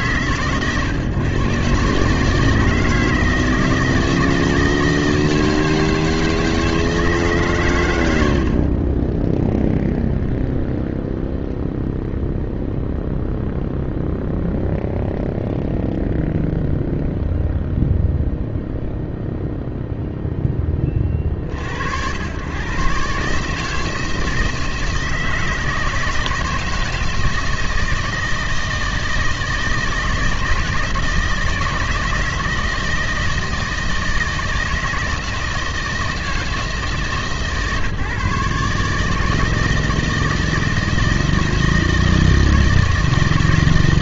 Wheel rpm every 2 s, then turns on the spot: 130, 160, 160, 160, 40, 0, 0, 0, 0, 0, 20, 120, 160, 160, 160, 160, 160, 160, 160, 150, 160, 160.
none